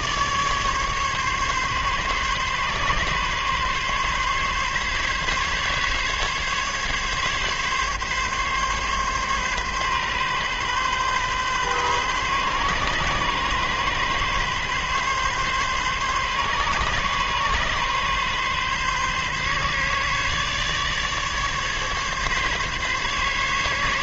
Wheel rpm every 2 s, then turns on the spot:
150, 140, 140, 140, 140, 130, 140, 130, 140, 140, 150, 140.
none